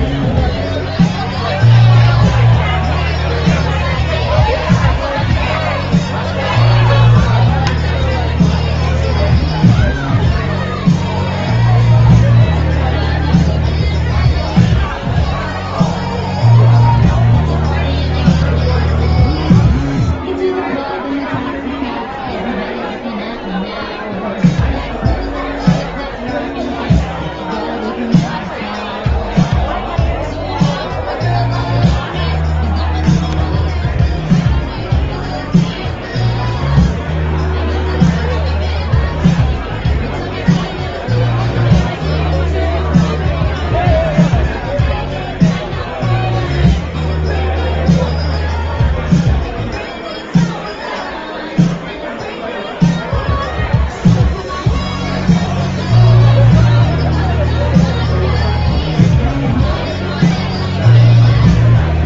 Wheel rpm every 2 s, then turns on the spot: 0, 0, 0, 0, 0, 0, 0, 0, 0, 0, 0, 0, 0, 0, 0, 0, 0, 0, 0, 0, 0, 0, 0, 0, 0, 0, 0, 0, 0, 0, 0.
none